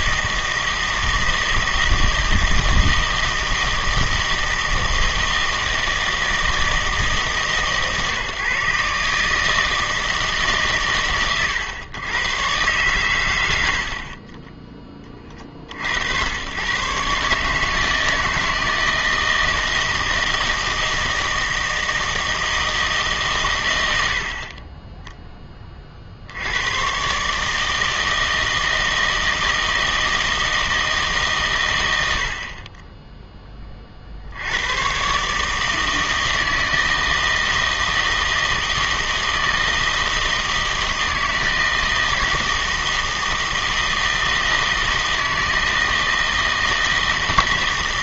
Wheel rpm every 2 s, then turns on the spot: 160, 160, 160, 160, 150, 130, 130, 20, 130, 160, 160, 160, 20, 100, 160, 160, 30, 110, 160, 160, 160, 160, 160, 160.
none